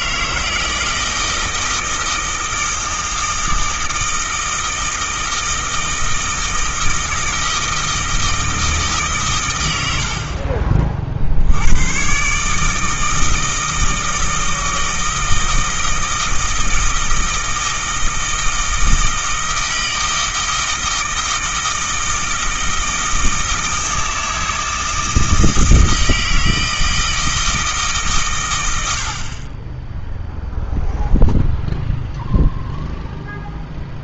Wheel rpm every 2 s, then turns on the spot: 160, 160, 160, 160, 160, 40, 160, 160, 160, 160, 160, 160, 160, 160, 90, 0, 0.
none